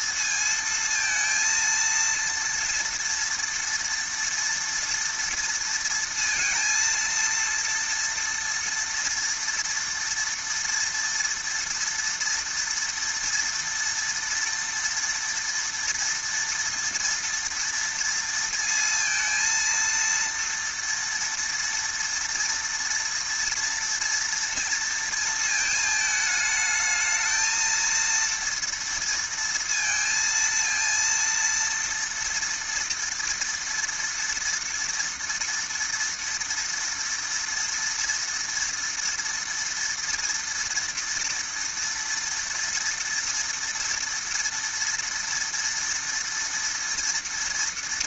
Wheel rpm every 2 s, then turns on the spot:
230, 230, 230, 230, 230, 230, 230, 230, 230, 230, 230, 230, 230, 210, 230, 230, 230, 240, 230, 230, 230, 230, 230, 230.
none